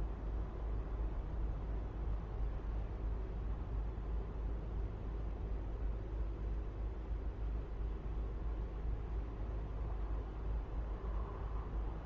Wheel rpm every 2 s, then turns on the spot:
0, 0, 0, 0, 0, 0.
none